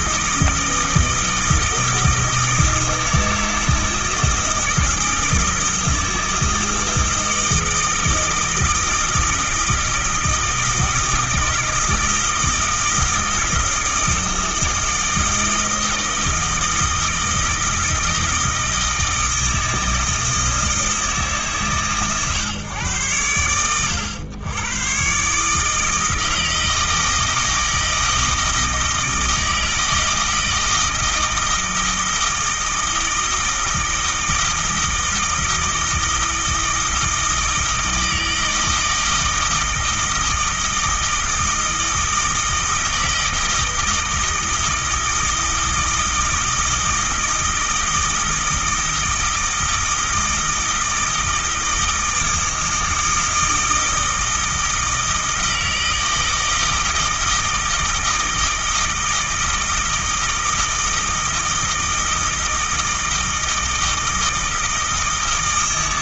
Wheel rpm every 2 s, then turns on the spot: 160, 160, 160, 160, 160, 160, 160, 160, 160, 160, 160, 120, 110, 160, 160, 160, 160, 160, 160, 160, 160, 160, 160, 160, 160, 160, 160, 160, 160, 160, 160, 160, 160.
none